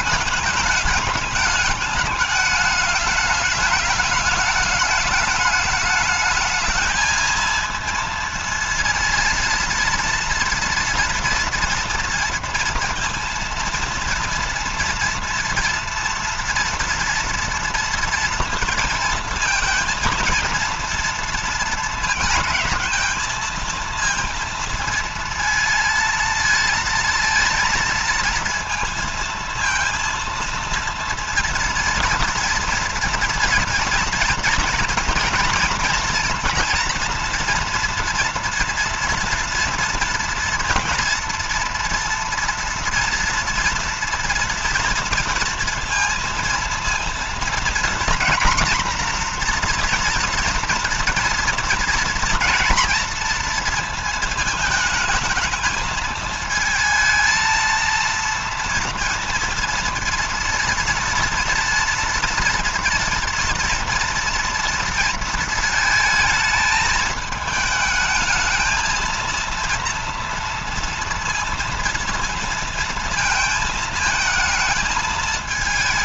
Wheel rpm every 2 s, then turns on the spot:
210, 210, 210, 210, 230, 230, 230, 230, 230, 230, 230, 220, 230, 230, 230, 230, 230, 230, 240, 230, 230, 230, 230, 230, 240, 230, 230, 220, 220, 230, 230, 230, 230, 220, 220, 230, 230, 220.
none